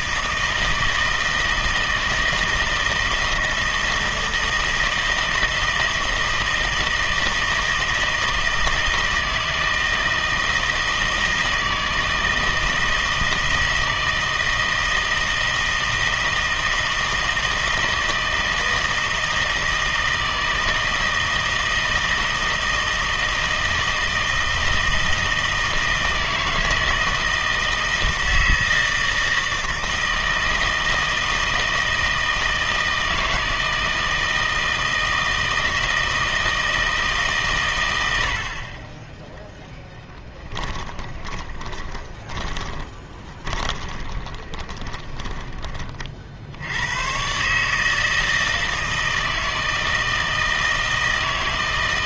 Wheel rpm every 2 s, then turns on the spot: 160, 160, 160, 160, 160, 160, 160, 160, 160, 160, 160, 160, 160, 160, 160, 160, 160, 160, 160, 40, 20, 20, 20, 70, 160, 160.
40-46